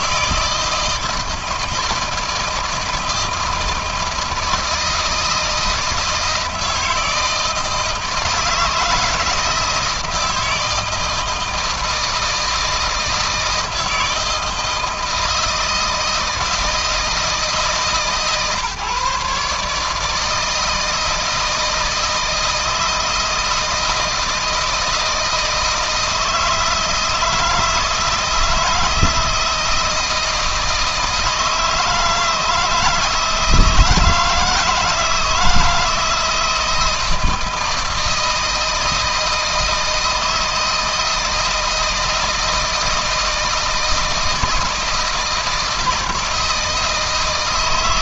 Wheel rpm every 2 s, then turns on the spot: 160, 160, 160, 160, 160, 160, 160, 160, 160, 130, 160, 160, 160, 160, 160, 160, 160, 170, 160, 160, 160, 160, 160, 160.
none